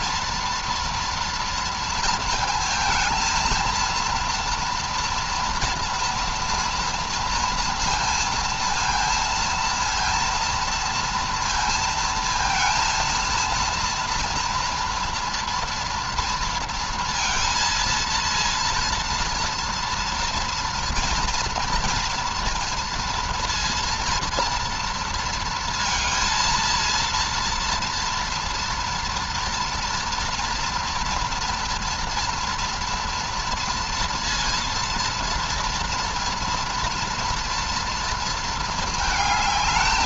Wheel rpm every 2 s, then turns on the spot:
230, 230, 240, 230, 230, 230, 230, 230, 230, 230, 230, 230, 230, 230, 230, 240, 230, 230, 240, 220.
none